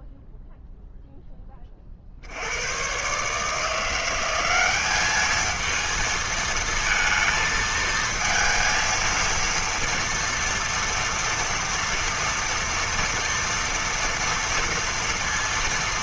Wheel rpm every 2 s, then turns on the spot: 0, 80, 190, 220, 230, 230, 230, 230.
none